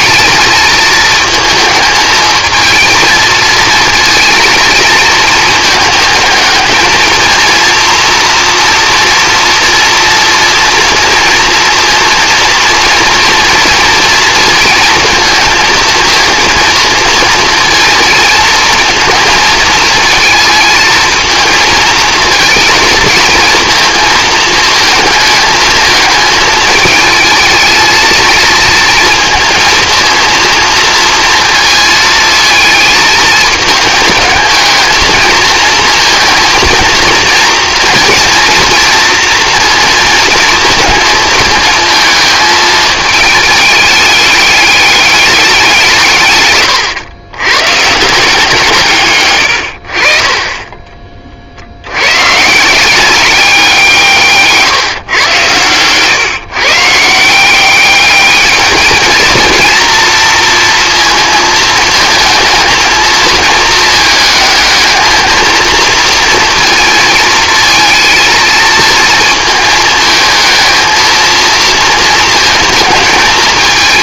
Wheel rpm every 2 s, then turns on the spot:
220, 230, 220, 220, 230, 240, 240, 230, 230, 230, 220, 220, 220, 210, 230, 230, 220, 220, 230, 230, 230, 220, 200, 110, 140, 20, 170, 140, 160, 220, 230, 220, 220, 230, 220, 220, 220.
none